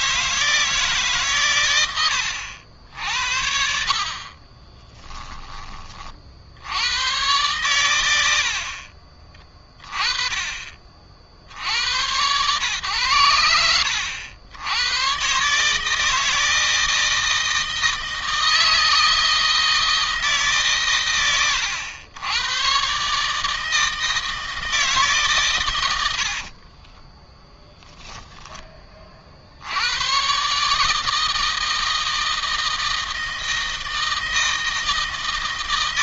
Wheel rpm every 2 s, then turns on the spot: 160, 80, 30, 80, 60, 30, 100, 90, 160, 160, 140, 110, 160, 40, 10, 140, 160, 160.
4-6 26-28